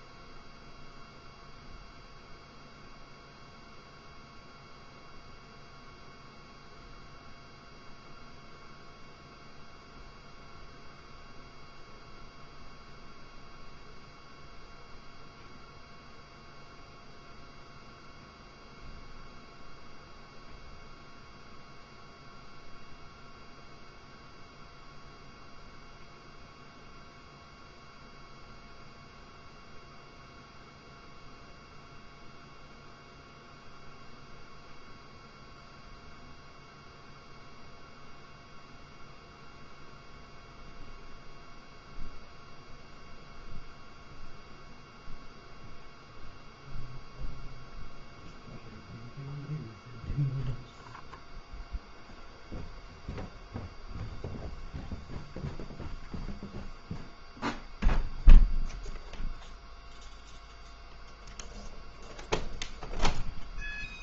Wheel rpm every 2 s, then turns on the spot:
0, 0, 0, 0, 0, 0, 0, 0, 0, 0, 0, 0, 0, 0, 0, 0, 0, 0, 0, 0, 0, 0, 0, 0, 0, 0, 0, 0, 0, 0, 0, 0.
none